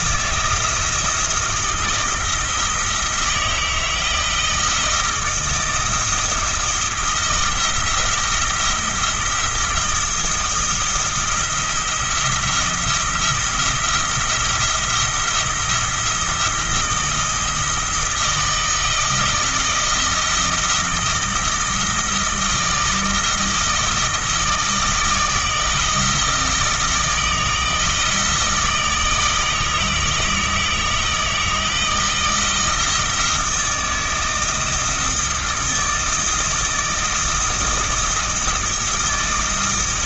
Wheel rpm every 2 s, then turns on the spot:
170, 160, 170, 170, 170, 170, 170, 170, 170, 160, 160, 160, 160, 160, 160, 160, 160, 160, 160, 160.
none